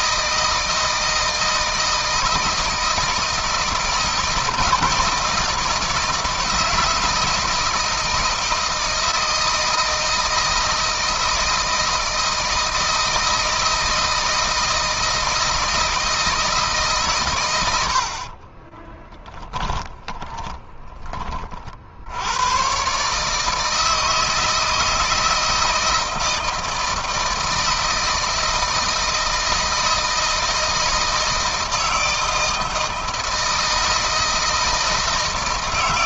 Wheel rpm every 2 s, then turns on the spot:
160, 160, 160, 160, 160, 160, 160, 160, 150, 30, 20, 130, 160, 160, 160, 160, 160, 160.
18-20